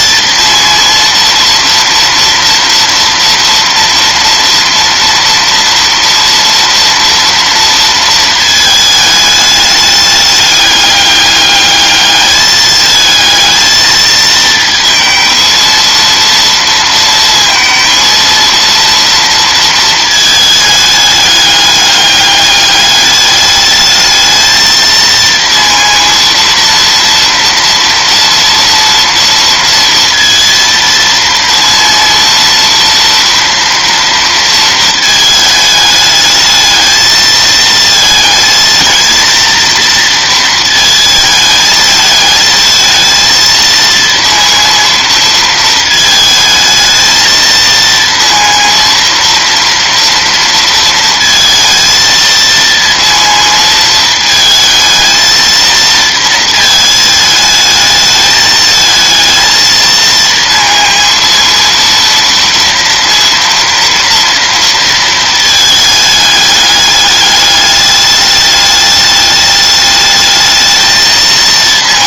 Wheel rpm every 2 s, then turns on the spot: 230, 230, 230, 230, 220, 210, 210, 230, 230, 230, 210, 210, 220, 230, 230, 230, 230, 230, 220, 220, 230, 220, 230, 220, 230, 230, 230, 220, 220, 220, 230, 230, 230, 210, 210, 220.
none